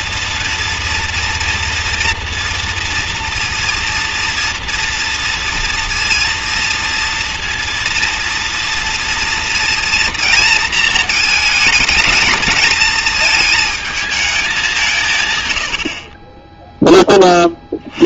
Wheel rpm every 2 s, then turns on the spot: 230, 230, 230, 230, 230, 230, 210, 190, 10.
none